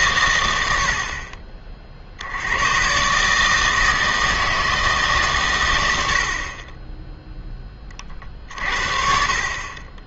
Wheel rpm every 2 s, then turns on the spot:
80, 120, 160, 30, 50.
6-8